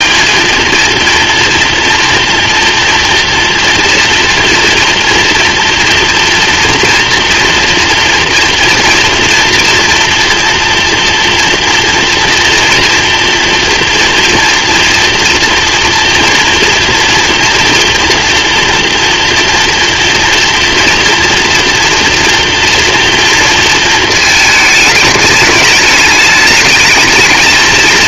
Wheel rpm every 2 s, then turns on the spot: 230, 240, 230, 230, 230, 230, 230, 230, 230, 230, 230, 230, 220, 210.
none